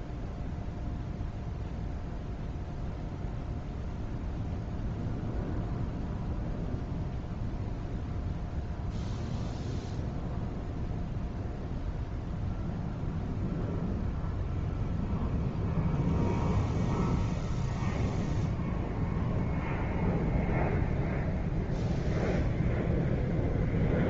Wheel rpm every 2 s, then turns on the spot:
0, 0, 0, 0, 0, 0, 0, 0, 0, 0, 0, 0.
none